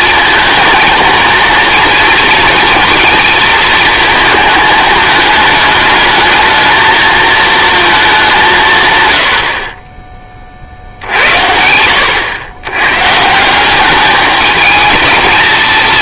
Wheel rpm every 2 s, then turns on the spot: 230, 230, 220, 220, 150, 40, 100, 220.
none